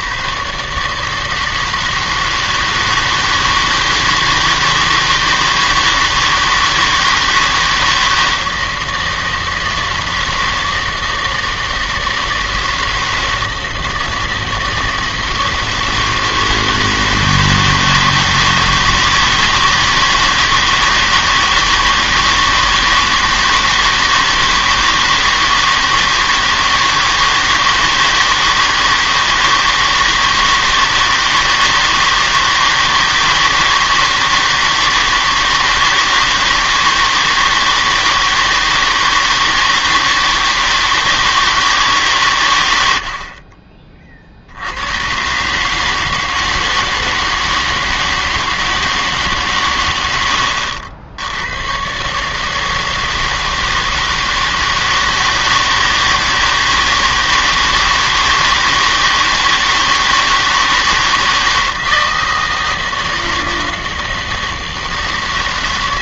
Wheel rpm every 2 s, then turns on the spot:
150, 160, 160, 160, 160, 160, 160, 160, 160, 160, 160, 160, 160, 160, 160, 160, 160, 160, 160, 160, 160, 100, 80, 160, 160, 80, 160, 160, 160, 160, 160, 160, 160.
none